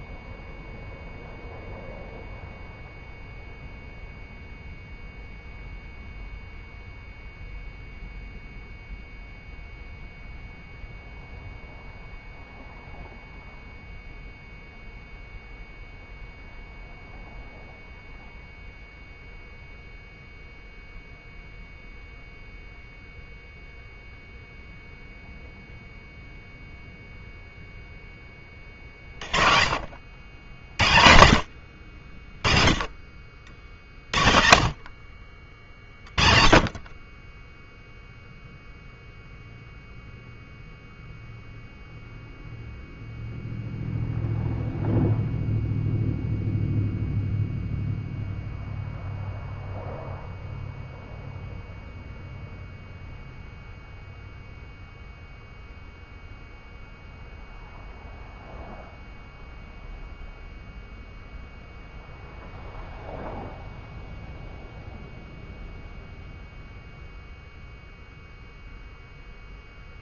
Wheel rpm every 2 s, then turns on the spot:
0, 0, 0, 0, 0, 0, 0, 0, 0, 0, 0, 0, 0, 0, 30, 90, 50, 50, 30, 0, 0, 0, 0, 0, 0, 0, 0, 0, 0, 0, 0, 0, 0, 0, 0.
none